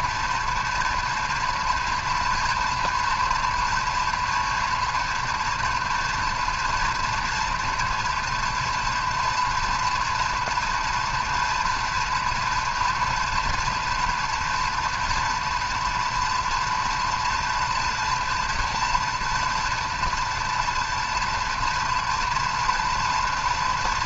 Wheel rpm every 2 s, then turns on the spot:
230, 230, 240, 230, 230, 230, 230, 230, 230, 230, 230, 230.
none